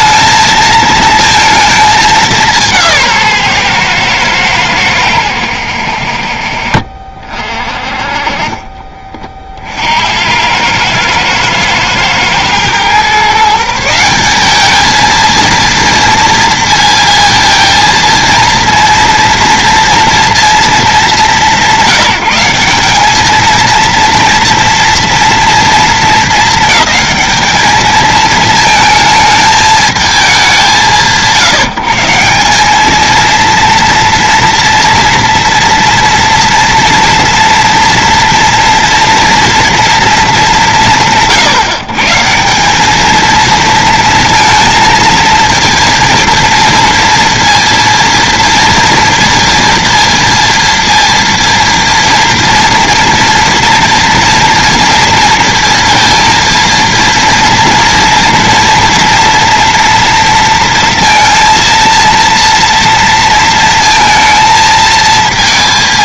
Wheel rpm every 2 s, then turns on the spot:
230, 170, 110, 50, 30, 110, 120, 210, 230, 230, 210, 190, 230, 220, 220, 160, 200, 230, 230, 230, 140, 200, 230, 230, 230, 230, 240, 230, 230, 230, 230, 230, 230.
8-10